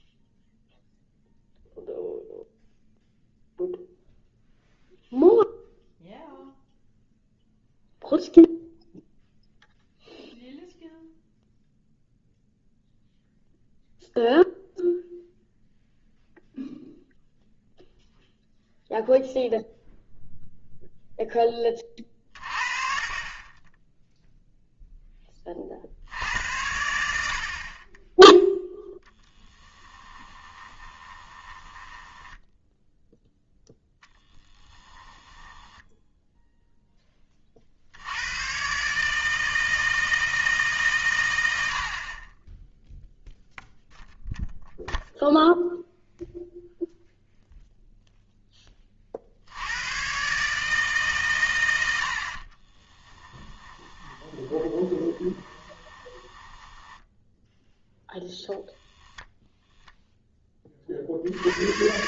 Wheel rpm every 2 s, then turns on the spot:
0, 0, 0, 0, 0, 0, 0, 0, 0, 0, 0, 50, 0, 80, 0, 20, 0, 10, 10, 140, 140, 10, 0, 0, 30, 150, 20, 20, 10, 0, 30.
30-32 34-36 52-58